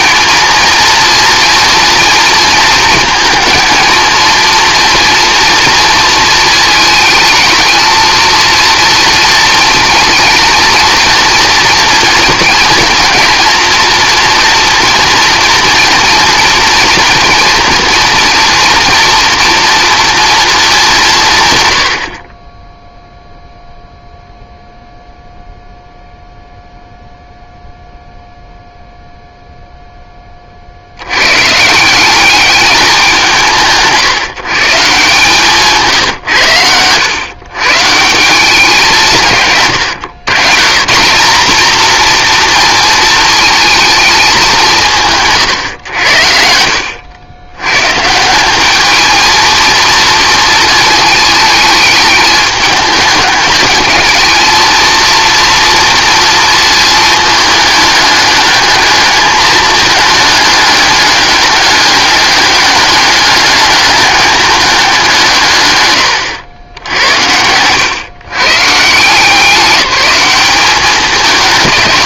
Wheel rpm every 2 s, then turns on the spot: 230, 220, 230, 220, 230, 230, 230, 230, 230, 240, 190, 0, 0, 0, 0, 80, 200, 150, 100, 170, 160, 230, 170, 80, 210, 220, 210, 230, 220, 210, 210, 200, 190, 90, 150, 200.
none